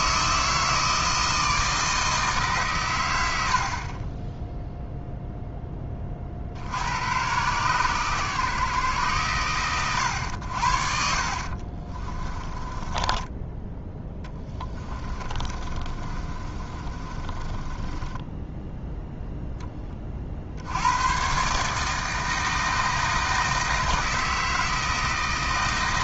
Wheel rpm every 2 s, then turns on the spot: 160, 130, 0, 90, 110, 60, 20, 20, 30, 10, 90, 160, 160.
12-18